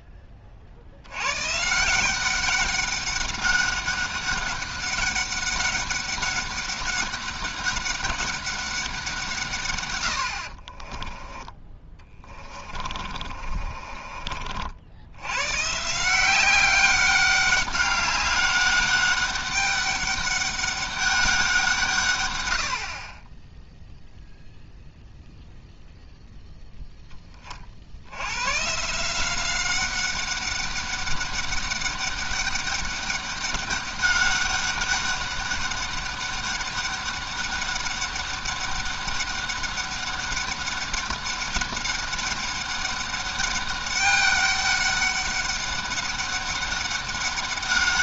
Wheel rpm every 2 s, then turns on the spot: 60, 200, 200, 200, 190, 40, 30, 60, 190, 200, 200, 80, 0, 0, 140, 200, 200, 200, 200, 200, 200, 200, 200, 200.
10-14